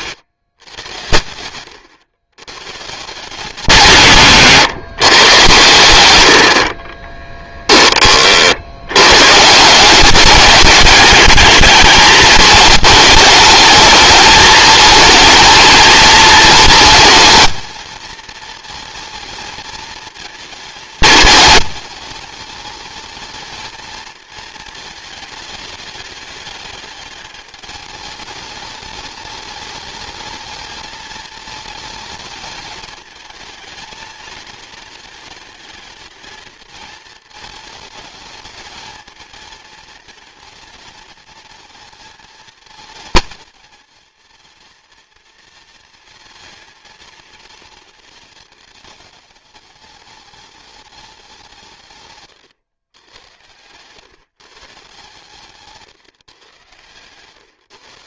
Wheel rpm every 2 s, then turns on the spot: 130, 140, 150, 40, 80, 200, 210, 220, 230, 220, 220, 220, 220, 210, 210, 220, 220, 220, 220, 220, 220, 230, 230, 230, 220, 210, 110, 140, 130.
56-58